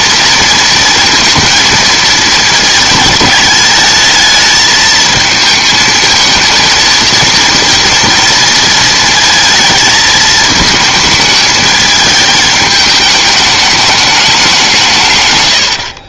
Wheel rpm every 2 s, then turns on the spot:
230, 230, 220, 230, 230, 220, 210, 170.
none